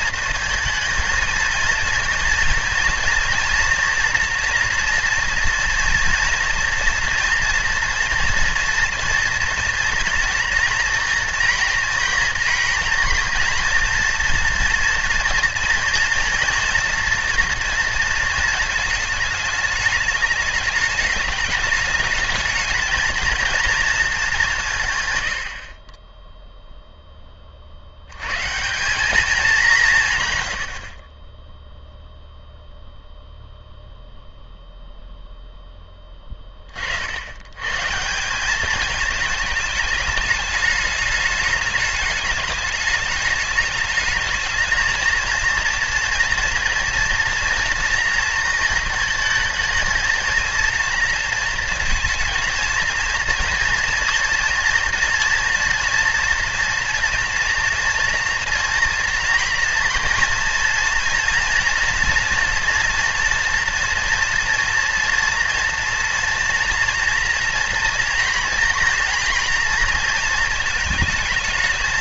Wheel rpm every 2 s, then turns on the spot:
230, 230, 230, 230, 230, 240, 230, 230, 240, 220, 210, 220, 170, 0, 150, 90, 0, 0, 40, 200, 210, 210, 220, 230, 230, 230, 230, 230, 230, 230, 230, 240, 230, 240, 230, 230.
none